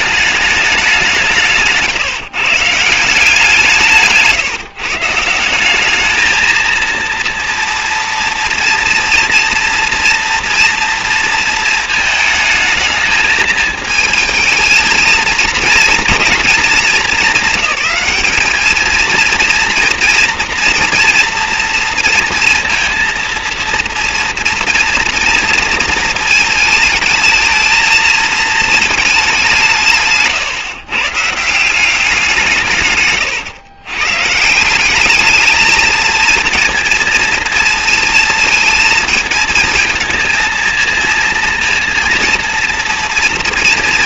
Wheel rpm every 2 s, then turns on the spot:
190, 160, 150, 230, 230, 230, 220, 230, 210, 220, 240, 230, 230, 220, 220, 140, 140, 190, 230, 230, 230, 230.
none